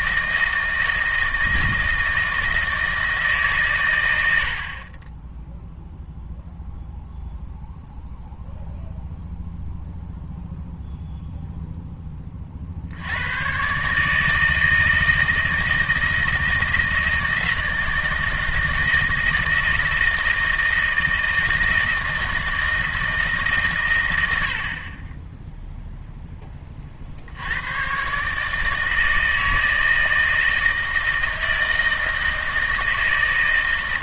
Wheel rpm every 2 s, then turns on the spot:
160, 160, 80, 0, 0, 0, 60, 160, 160, 160, 160, 160, 60, 20, 150, 160, 160.
none